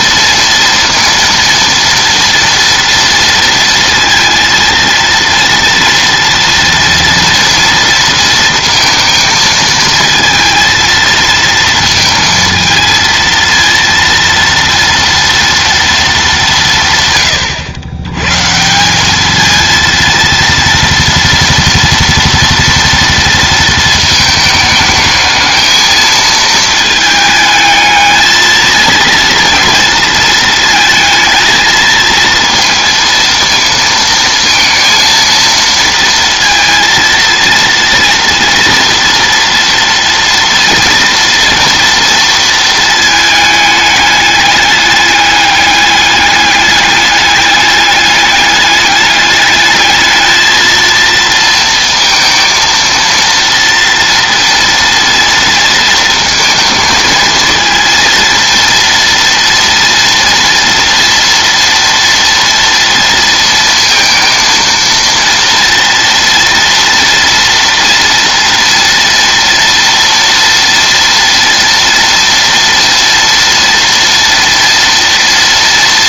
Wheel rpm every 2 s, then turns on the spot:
230, 230, 230, 230, 230, 230, 230, 230, 140, 190, 230, 230, 220, 220, 230, 220, 230, 230, 230, 230, 230, 220, 210, 210, 210, 220, 230, 230, 230, 230, 230, 230, 230, 230, 230, 230, 230, 230.
none